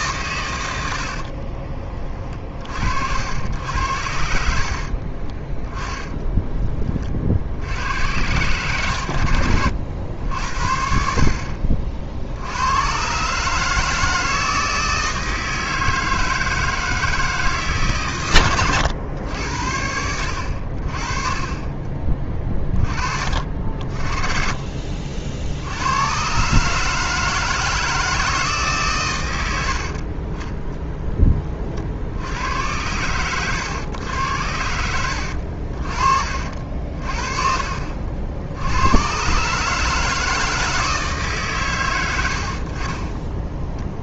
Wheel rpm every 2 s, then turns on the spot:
80, 70, 40, 30, 100, 60, 120, 160, 160, 110, 50, 30, 50, 150, 140, 10, 100, 80, 50, 100, 160, 40.
4-6